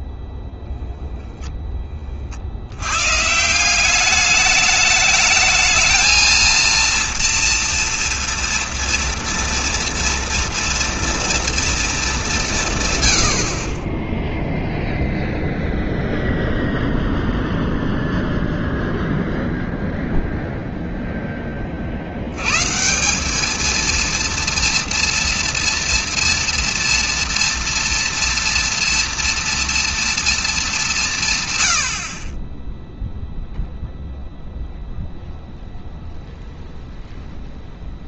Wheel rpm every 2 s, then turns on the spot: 0, 90, 210, 230, 230, 230, 140, 0, 0, 0, 10, 190, 230, 230, 230, 160, 0, 0, 0.
none